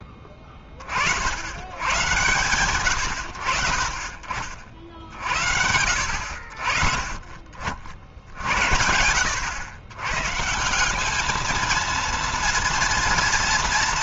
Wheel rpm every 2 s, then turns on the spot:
20, 110, 40, 60, 70, 160, 230.
none